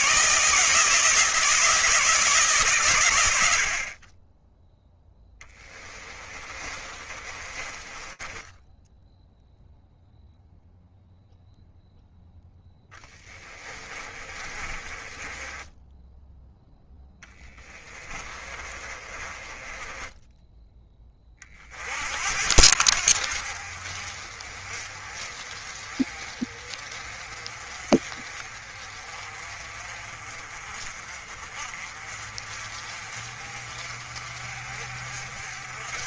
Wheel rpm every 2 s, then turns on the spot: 160, 120, 0, 30, 0, 0, 20, 20, 10, 20, 30, 70, 30, 30, 40, 40, 40, 50.
6-8 12-20